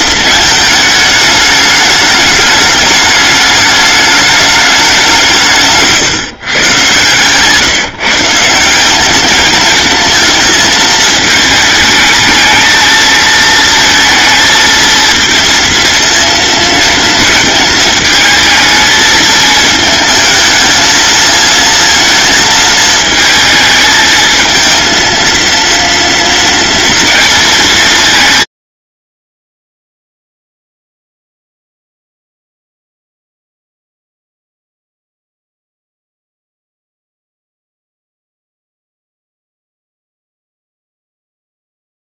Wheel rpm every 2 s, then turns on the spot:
220, 210, 200, 140, 190, 220, 220, 230, 220, 220, 220, 220, 230, 230, 60, 0, 0, 0, 0, 0, 0.
none